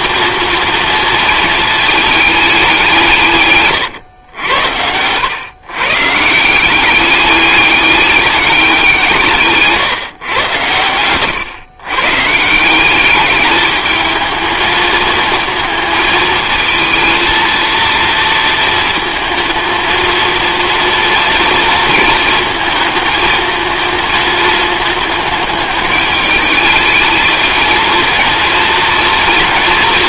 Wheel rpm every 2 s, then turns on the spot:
230, 180, 90, 190, 180, 110, 180, 220, 220, 230, 230, 220, 220, 210, 230.
10-12